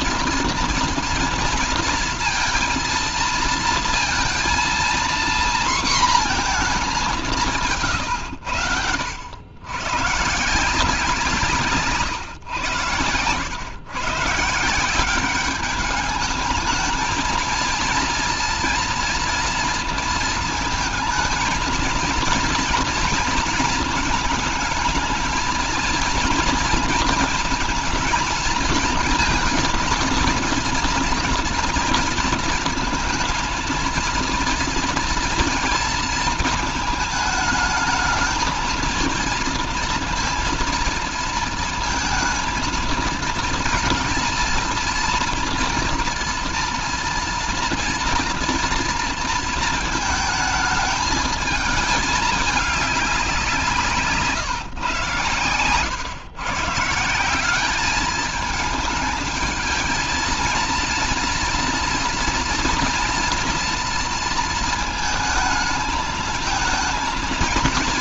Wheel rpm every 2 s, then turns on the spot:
230, 230, 230, 220, 90, 170, 120, 160, 220, 230, 220, 230, 220, 230, 220, 230, 230, 230, 230, 230, 230, 230, 230, 230, 230, 220, 200, 130, 140, 220, 230, 230, 230, 220.
none